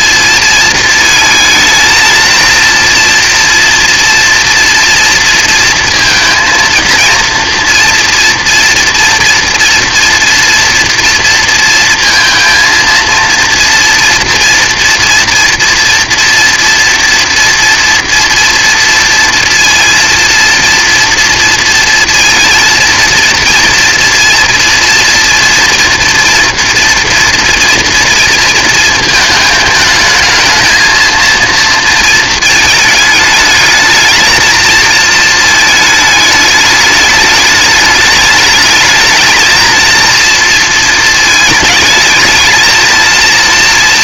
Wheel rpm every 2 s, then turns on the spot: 220, 230, 240, 230, 230, 240, 230, 230, 240, 230, 230, 230, 230, 230, 230, 220, 220, 220, 210, 210, 230, 220.
none